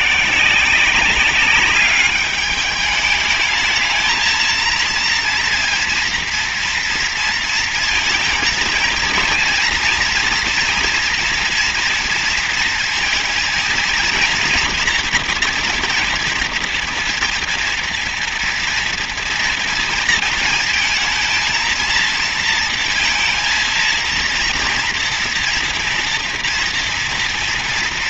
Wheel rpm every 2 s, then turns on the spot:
160, 200, 220, 230, 230, 230, 230, 230, 230, 230, 230, 230, 230, 240.
none